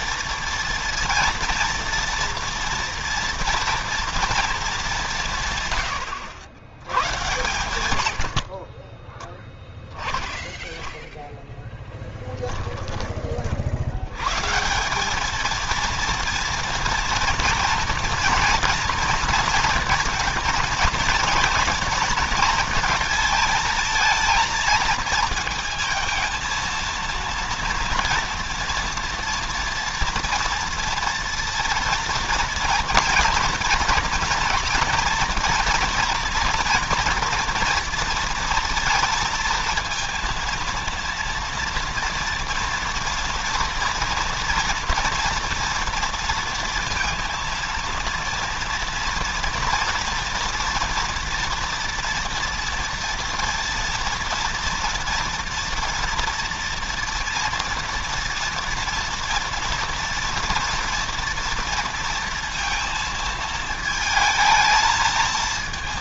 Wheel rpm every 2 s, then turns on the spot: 230, 240, 210, 110, 50, 0, 10, 160, 240, 240, 230, 230, 230, 220, 230, 230, 230, 230, 230, 230, 230, 230, 230, 230, 230, 230, 230, 230, 230, 230, 230, 230, 220.
8-10